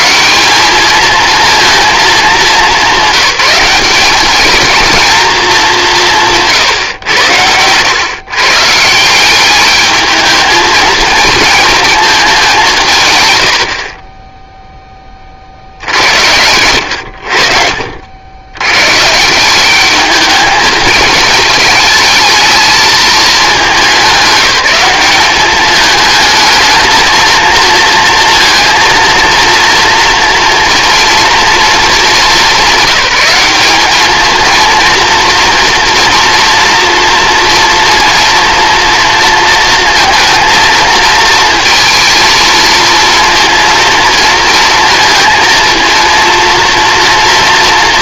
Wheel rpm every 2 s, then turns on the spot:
220, 200, 220, 100, 190, 230, 110, 30, 80, 150, 210, 210, 200, 230, 230, 230, 200, 230, 230, 230, 220, 230, 230, 230.
none